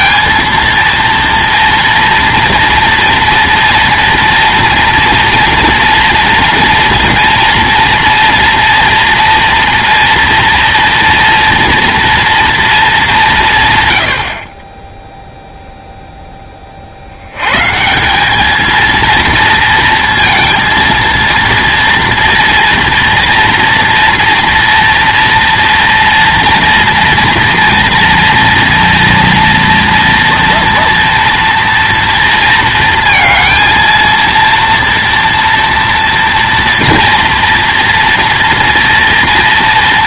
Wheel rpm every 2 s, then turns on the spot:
230, 230, 230, 230, 240, 230, 230, 40, 30, 220, 230, 230, 230, 230, 230, 230, 230, 230, 230, 230.
none